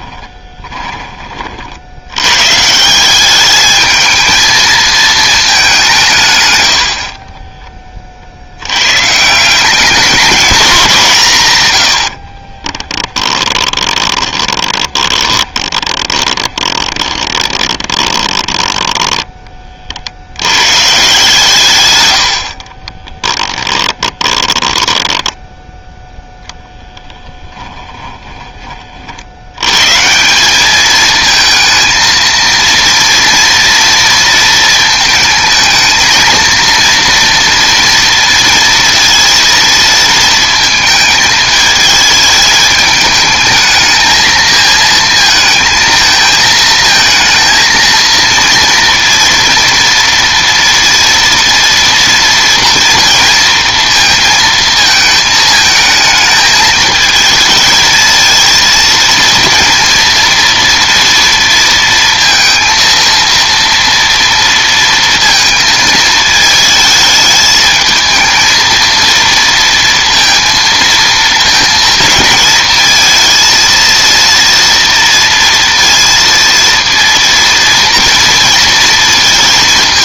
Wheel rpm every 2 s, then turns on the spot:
20, 150, 220, 100, 100, 200, 30, 20, 20, 10, 120, 40, 10, 0, 30, 210, 230, 220, 230, 230, 220, 220, 220, 220, 230, 230, 230, 220, 220, 230, 230, 230, 230, 220, 230, 230, 220, 230, 230, 230.
0-2 6-8 12-20 22-26